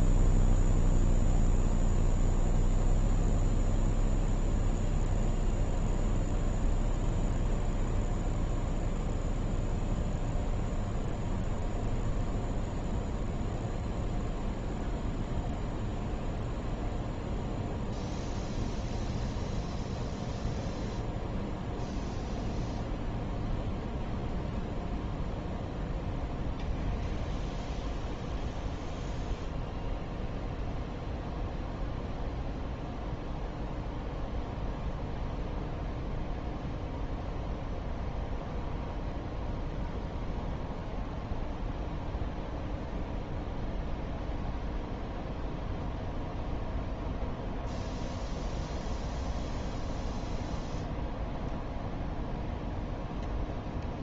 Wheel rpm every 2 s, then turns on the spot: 0, 0, 0, 0, 0, 0, 0, 0, 0, 0, 0, 0, 0, 0, 0, 0, 0, 0, 0, 0, 0, 0, 0, 0, 0, 0, 0.
none